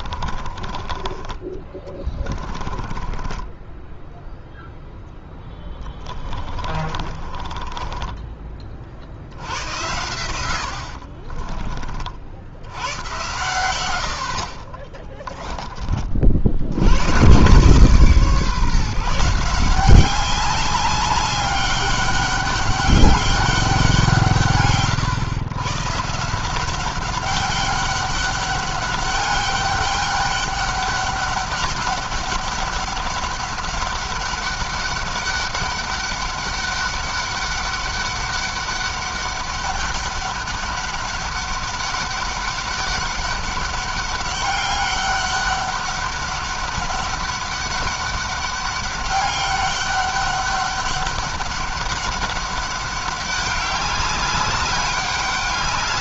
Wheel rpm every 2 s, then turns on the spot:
30, 20, 0, 40, 50, 80, 90, 30, 90, 160, 200, 200, 130, 180, 200, 200, 200, 200, 200, 200, 200, 200, 200, 200, 200, 200, 200, 190.
0-4 6-8 10-12 14-16